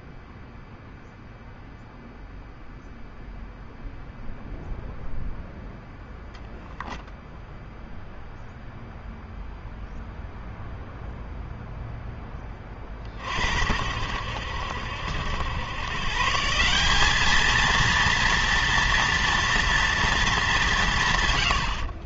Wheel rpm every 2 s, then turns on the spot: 0, 0, 0, 0, 0, 0, 40, 70, 190, 230, 160.
none